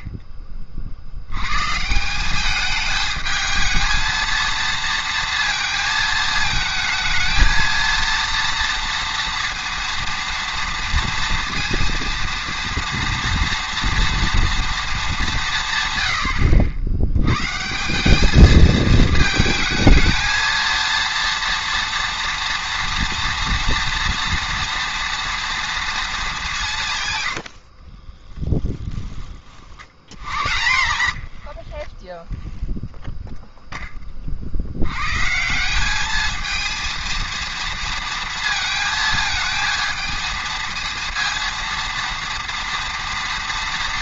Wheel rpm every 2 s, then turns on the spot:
40, 210, 230, 220, 230, 230, 230, 230, 80, 220, 230, 230, 230, 170, 10, 90, 0, 80, 220, 220, 230, 230.
30-32